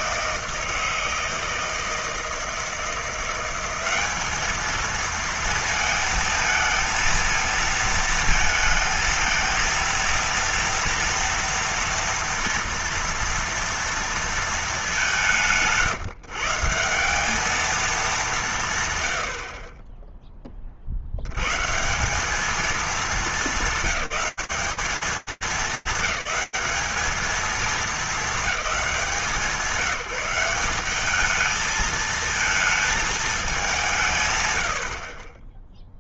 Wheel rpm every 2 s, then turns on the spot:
160, 160, 220, 230, 220, 230, 230, 220, 170, 170, 30, 210, 200, 200, 200, 190, 220, 110.
none